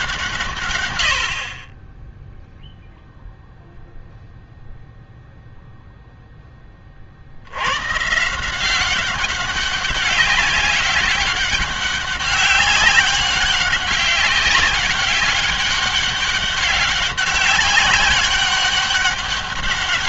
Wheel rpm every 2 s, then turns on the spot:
130, 0, 0, 20, 180, 200, 200, 200, 200, 200.
none